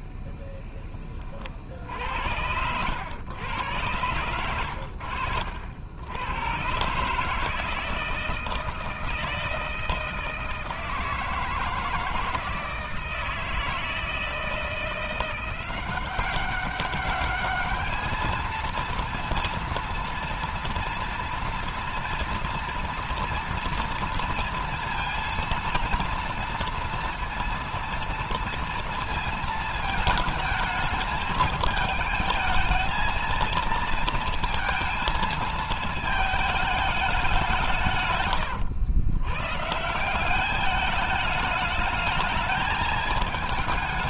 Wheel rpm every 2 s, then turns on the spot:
10, 90, 100, 120, 160, 160, 160, 170, 190, 230, 230, 240, 230, 230, 230, 220, 220, 230, 220, 110, 210, 220.
none